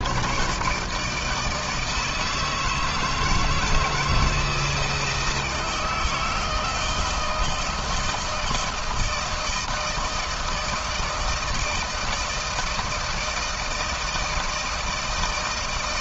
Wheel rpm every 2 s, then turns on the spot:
150, 160, 160, 160, 160, 160, 160, 160.
none